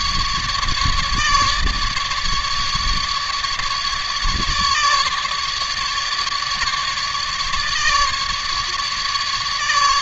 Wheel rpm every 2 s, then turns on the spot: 150, 150, 150, 150, 150.
none